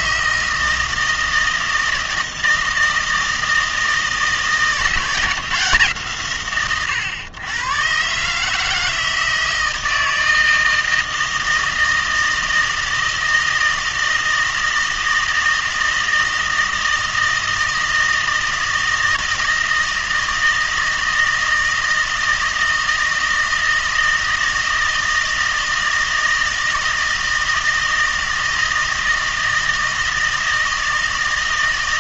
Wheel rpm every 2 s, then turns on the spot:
160, 160, 170, 130, 160, 160, 160, 160, 160, 160, 160, 160, 160, 160, 160, 160.
none